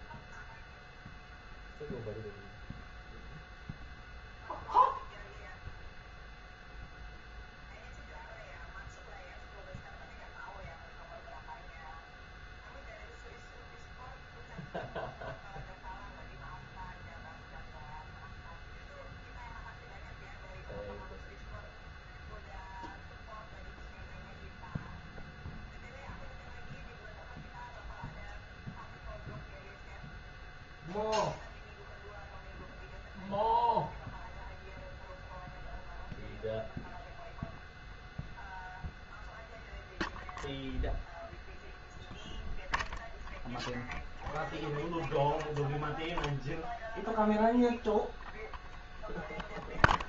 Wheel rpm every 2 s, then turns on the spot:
0, 0, 0, 0, 0, 0, 0, 0, 0, 0, 0, 0, 0, 0, 0, 0, 0, 0, 0, 0, 0, 0, 0, 0, 0.
none